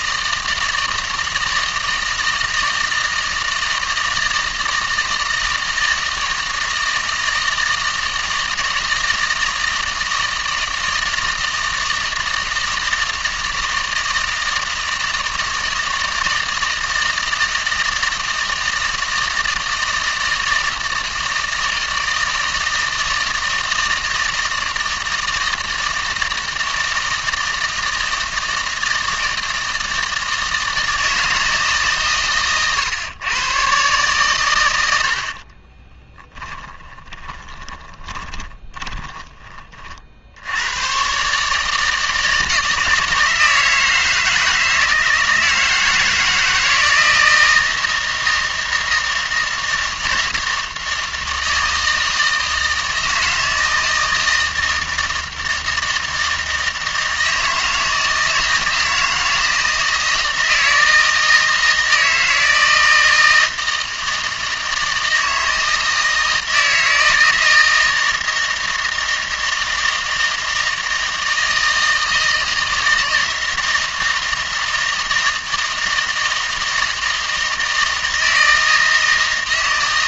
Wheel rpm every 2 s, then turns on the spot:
160, 160, 160, 160, 160, 160, 160, 160, 160, 160, 160, 160, 160, 160, 160, 160, 120, 100, 20, 20, 100, 160, 160, 170, 160, 160, 160, 160, 160, 160, 160, 160, 160, 160, 160, 160, 160, 160, 160, 160.
36-40